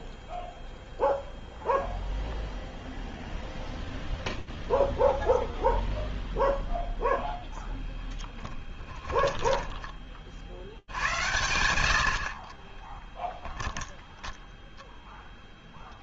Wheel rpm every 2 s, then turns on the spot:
0, 0, 0, 10, 10, 100, 10, 0.
8-10 12-14